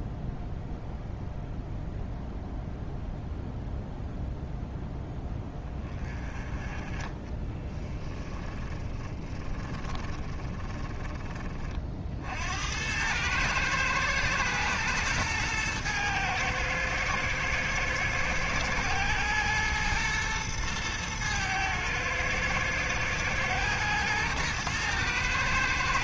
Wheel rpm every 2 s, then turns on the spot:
0, 0, 0, 20, 30, 20, 80, 110, 110, 110, 110, 110, 110.
8-12